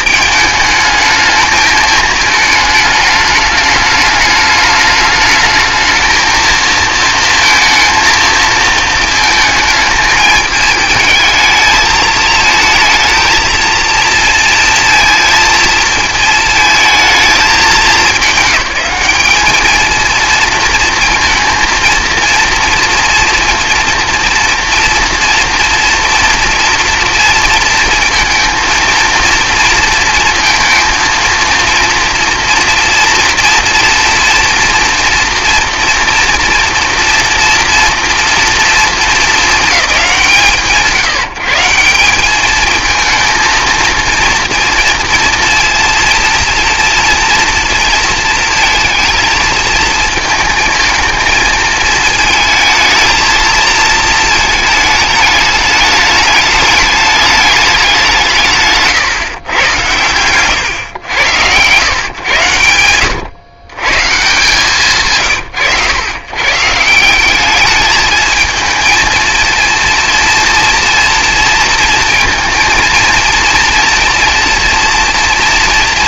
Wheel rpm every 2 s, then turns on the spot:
220, 210, 210, 230, 220, 220, 230, 230, 220, 200, 230, 230, 230, 230, 230, 230, 230, 230, 230, 230, 140, 220, 230, 230, 230, 220, 220, 220, 210, 140, 110, 100, 130, 160, 230, 230, 230, 240.
none